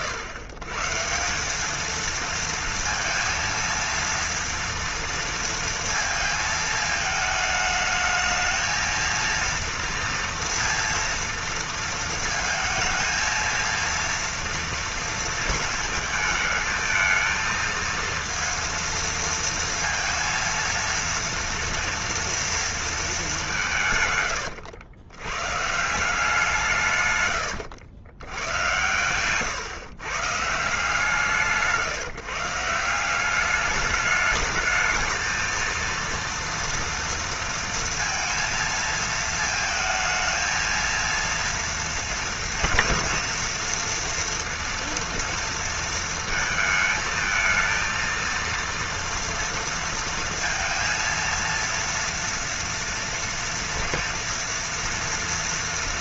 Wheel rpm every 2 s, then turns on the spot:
130, 230, 230, 220, 220, 230, 230, 230, 220, 230, 230, 230, 100, 150, 110, 160, 170, 220, 230, 230, 230, 230, 230, 220, 230, 230, 230, 240.
none